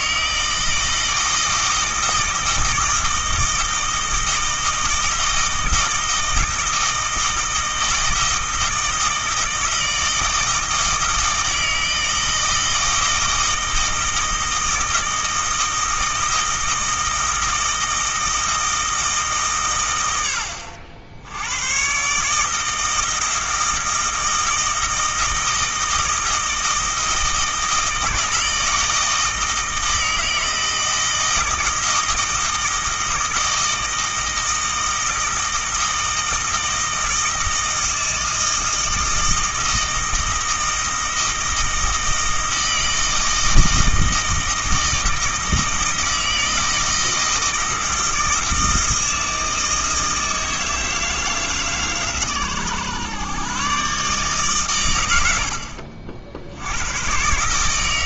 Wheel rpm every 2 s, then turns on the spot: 160, 160, 160, 160, 160, 160, 160, 160, 160, 160, 70, 160, 160, 160, 160, 160, 160, 160, 160, 160, 160, 160, 160, 160, 160, 160, 110, 120, 100.
none